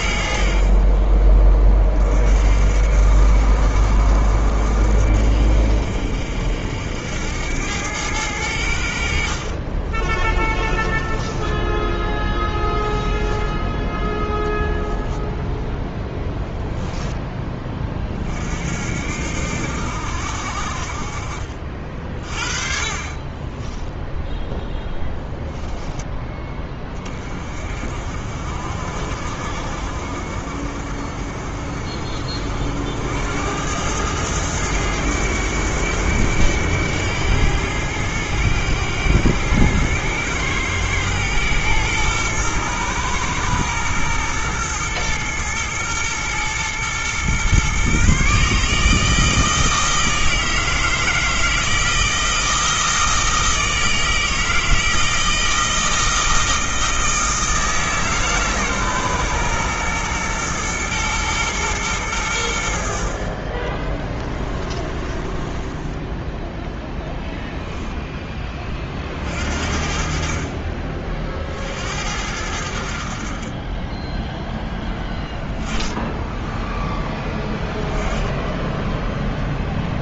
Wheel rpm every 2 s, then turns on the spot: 50, 50, 60, 70, 70, 20, 20, 10, 10, 60, 50, 40, 0, 20, 50, 50, 70, 100, 90, 90, 110, 120, 110, 120, 150, 160, 160, 160, 160, 130, 110, 70, 30, 10, 30, 40, 70, 10, 10, 0.
10-16 64-66